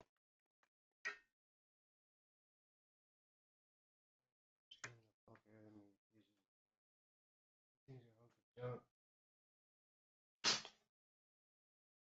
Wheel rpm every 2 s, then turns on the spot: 0, 0, 0, 0, 0, 0.
none